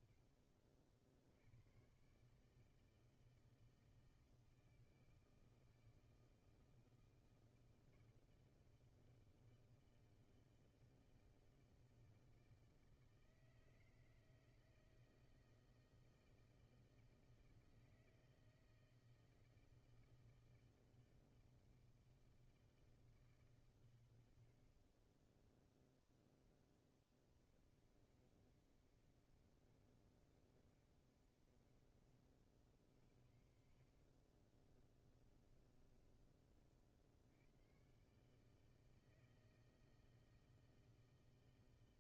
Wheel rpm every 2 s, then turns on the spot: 70, 150, 160, 160, 160, 160, 160, 160, 160, 160, 160, 130, 10, 50, 60, 50, 70, 30, 90, 160, 160.
32-36